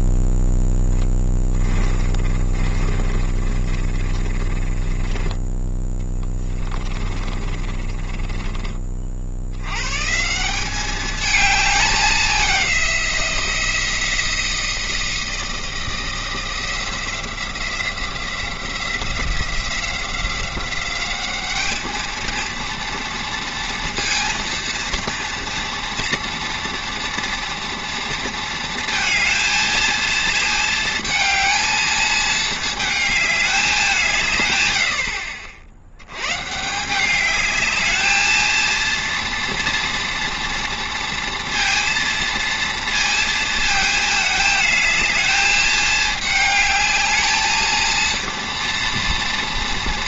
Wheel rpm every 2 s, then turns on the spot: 10, 30, 20, 20, 20, 190, 190, 170, 170, 170, 190, 230, 230, 230, 230, 220, 220, 100, 160, 230, 230, 230, 210, 220, 240.
0-8